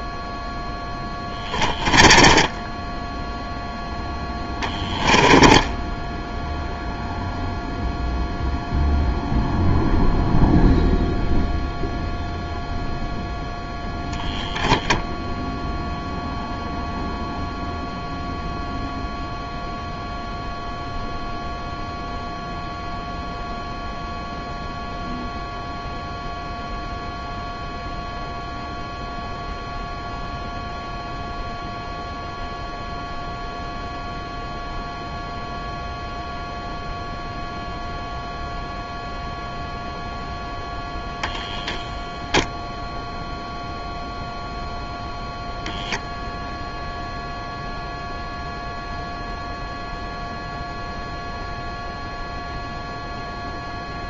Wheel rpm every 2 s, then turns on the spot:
0, 20, 10, 0, 0, 0, 0, 0, 0, 0, 0, 0, 0, 0, 0, 0, 0, 0, 0, 0, 10, 0, 0, 0, 0, 0, 0.
2-6